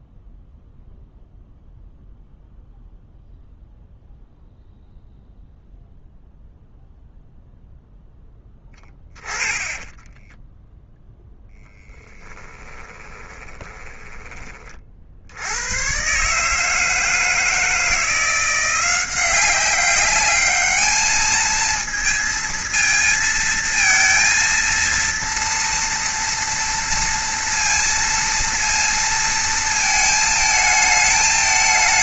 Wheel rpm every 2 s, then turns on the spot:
0, 0, 0, 0, 10, 0, 20, 30, 150, 180, 210, 230, 230, 230, 230, 220.
8-10 12-14